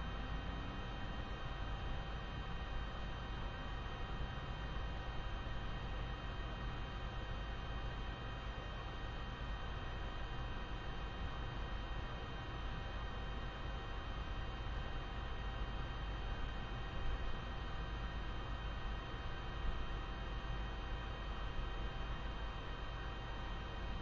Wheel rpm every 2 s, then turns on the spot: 0, 0, 0, 0, 0, 0, 0, 0, 0, 0, 0, 0.
none